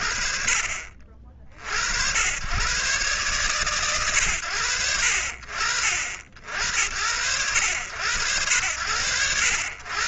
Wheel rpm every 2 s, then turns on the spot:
60, 120, 50, 80, 50.
none